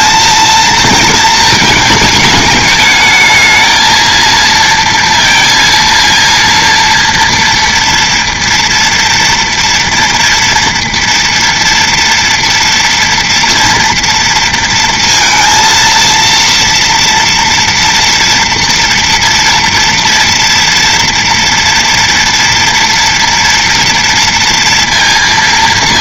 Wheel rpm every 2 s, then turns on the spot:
230, 210, 230, 230, 230, 240, 240, 230, 230, 230, 230, 230, 230.
none